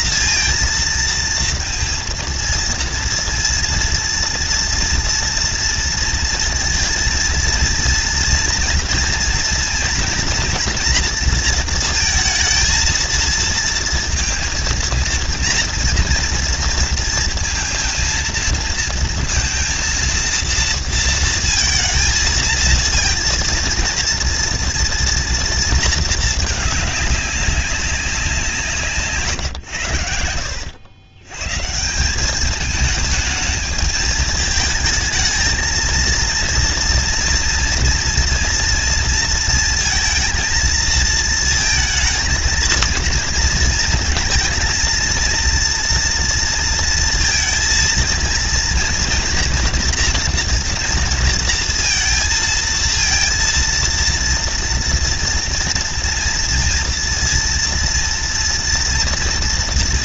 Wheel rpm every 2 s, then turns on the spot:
240, 230, 230, 230, 230, 230, 230, 230, 230, 230, 230, 220, 230, 220, 180, 80, 190, 220, 230, 230, 230, 230, 230, 230, 230, 230, 230, 230, 230, 230.
none